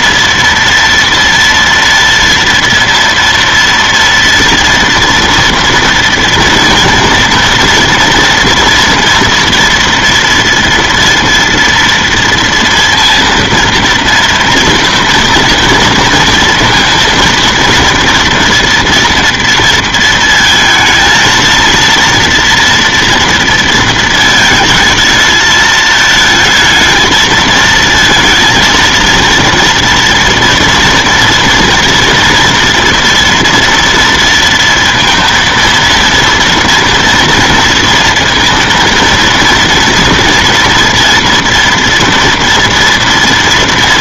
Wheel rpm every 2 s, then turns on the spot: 230, 230, 230, 230, 230, 230, 230, 230, 230, 240, 230, 240, 220, 220, 230, 230, 230, 230, 230, 230, 230, 230.
none